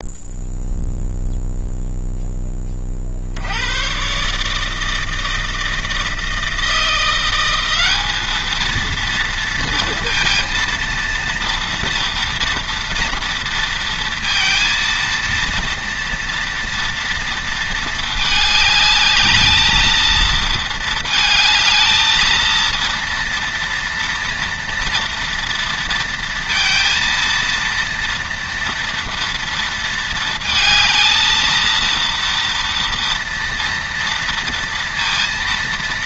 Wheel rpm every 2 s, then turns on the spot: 0, 20, 160, 170, 230, 230, 230, 230, 230, 210, 230, 230, 230, 230, 230, 230, 230, 230.
none